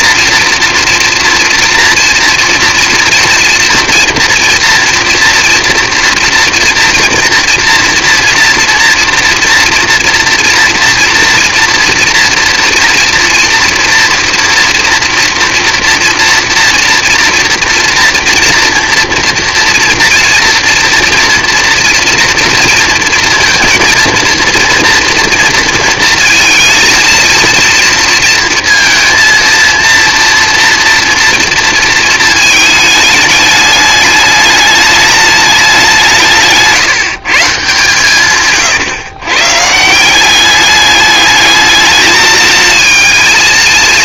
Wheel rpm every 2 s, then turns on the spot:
230, 240, 240, 230, 230, 230, 240, 230, 230, 230, 230, 240, 230, 230, 230, 230, 220, 210, 160, 140, 200, 220.
38-40